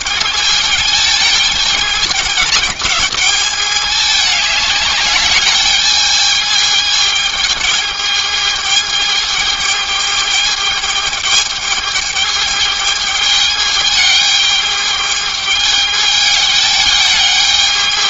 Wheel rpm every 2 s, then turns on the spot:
220, 210, 210, 210, 210, 210, 210, 210, 210.
none